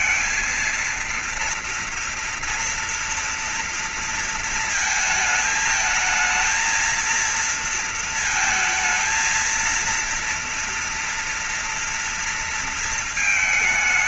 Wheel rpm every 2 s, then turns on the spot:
230, 230, 230, 220, 230, 230, 230.
none